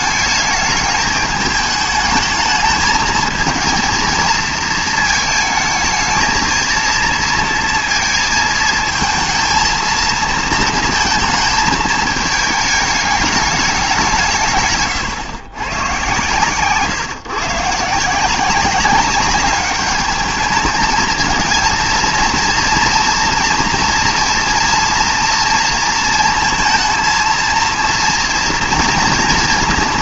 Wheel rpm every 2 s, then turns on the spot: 210, 220, 220, 230, 220, 230, 210, 130, 140, 200, 220, 230, 230, 230, 230.
none